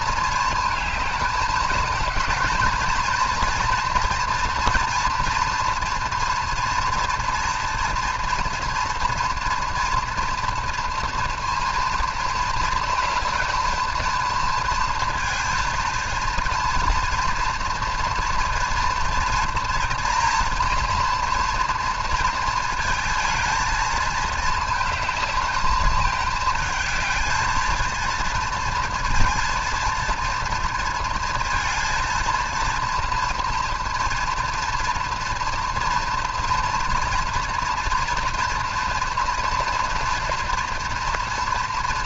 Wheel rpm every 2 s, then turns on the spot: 220, 220, 230, 230, 230, 230, 230, 230, 230, 230, 230, 230, 220, 220, 230, 230, 230, 230, 240, 230, 240.
none